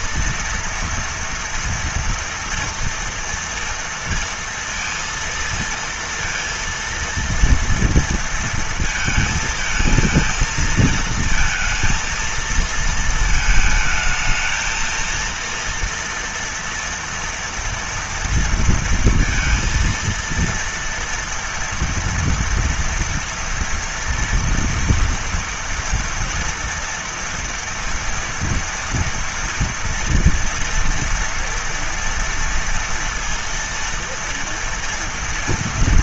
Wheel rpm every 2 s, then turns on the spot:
230, 230, 230, 230, 230, 230, 220, 220, 230, 230, 230, 230, 240, 230, 230, 230, 230, 230.
none